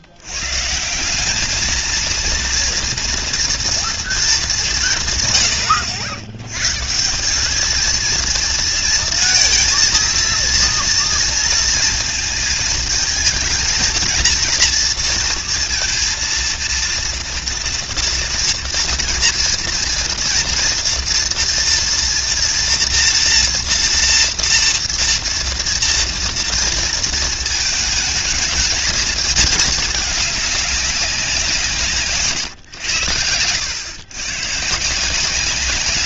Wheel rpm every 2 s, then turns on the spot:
180, 240, 160, 170, 230, 230, 220, 230, 230, 240, 230, 240, 230, 230, 220, 200, 100, 160.
none